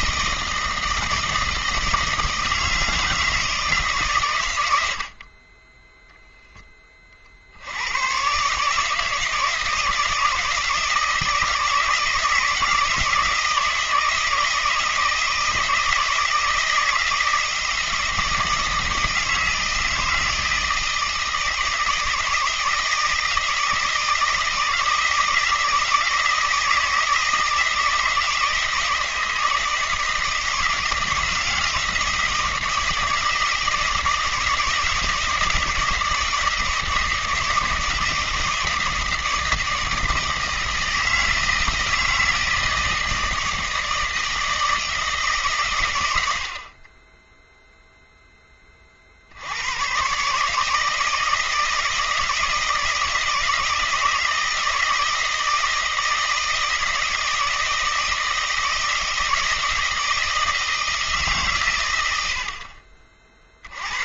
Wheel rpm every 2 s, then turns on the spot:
160, 160, 100, 10, 150, 160, 160, 160, 160, 160, 160, 160, 160, 160, 160, 160, 160, 160, 160, 160, 160, 160, 160, 40, 20, 150, 160, 160, 160, 160, 160, 50.
none